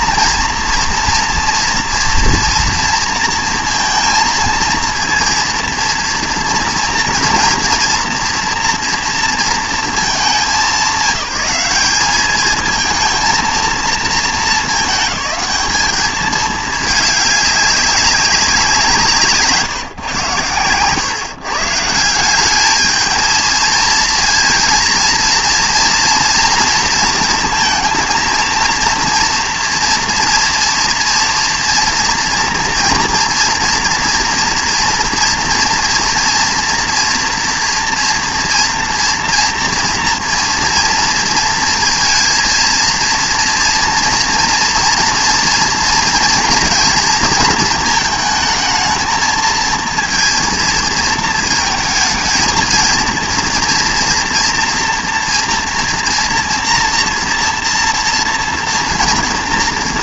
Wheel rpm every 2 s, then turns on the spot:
230, 230, 230, 230, 230, 190, 220, 220, 210, 190, 120, 200, 230, 230, 230, 230, 230, 230, 240, 230, 230, 230, 230, 230, 220, 230, 220, 230, 230, 230.
none